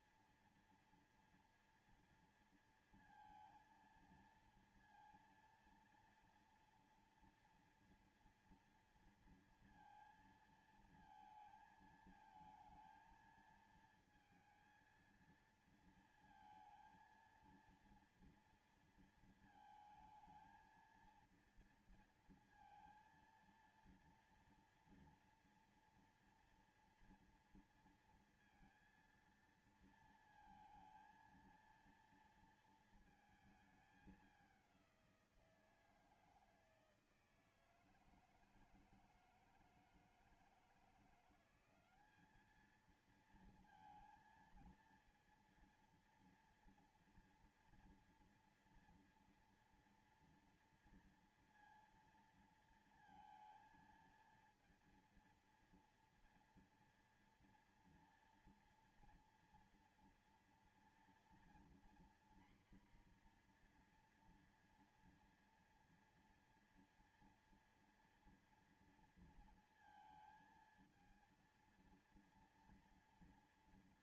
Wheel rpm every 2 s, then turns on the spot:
230, 230, 230, 230, 230, 230, 220, 230, 230, 230, 230, 230, 230, 240, 230, 230, 230, 190, 160, 160, 170, 210, 230, 240, 240, 230, 230, 230, 230, 230, 230, 240, 240, 240, 230, 230, 230.
none